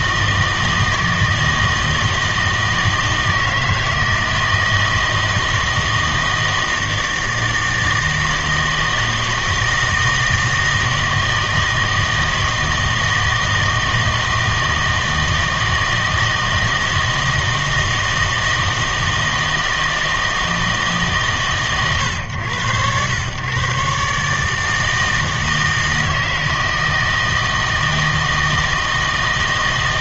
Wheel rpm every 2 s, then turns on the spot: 160, 160, 160, 160, 160, 160, 160, 160, 160, 160, 160, 100, 160, 160, 160.
none